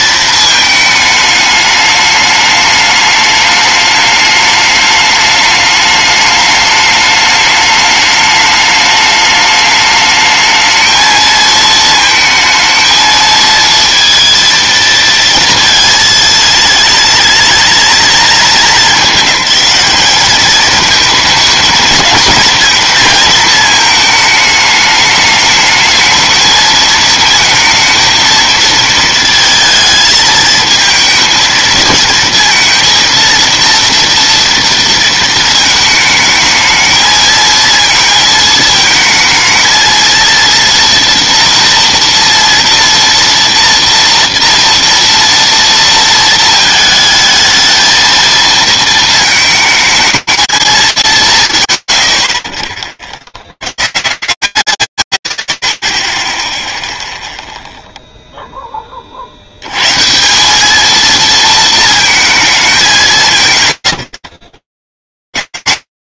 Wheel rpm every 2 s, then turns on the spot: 220, 210, 210, 210, 210, 220, 220, 230, 230, 220, 220, 230, 210, 220, 230, 220, 230, 230, 220, 220, 230, 230, 230, 220, 230, 210, 30, 130, 0, 10, 200, 210, 130.
none